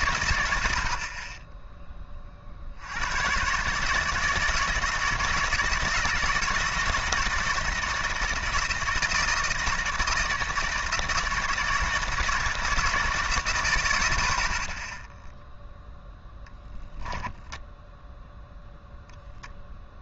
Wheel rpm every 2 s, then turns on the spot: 80, 60, 160, 160, 160, 160, 150, 60, 0, 0.
none